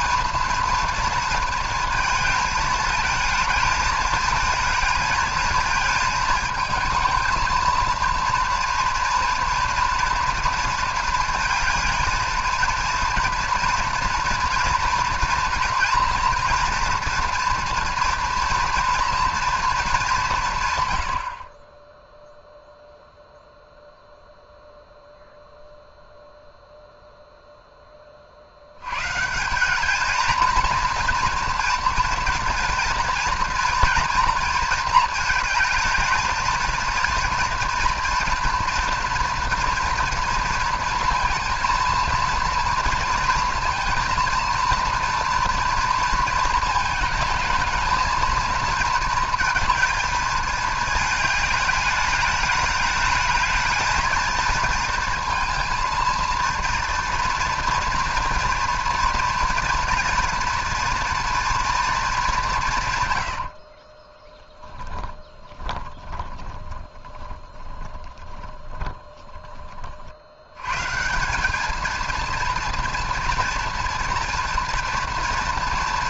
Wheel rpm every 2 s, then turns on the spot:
230, 220, 220, 220, 230, 230, 230, 230, 230, 230, 130, 0, 0, 0, 90, 230, 230, 220, 230, 240, 230, 230, 230, 220, 230, 220, 210, 230, 230, 230, 230, 170, 10, 20, 20, 120, 230, 230.
64-70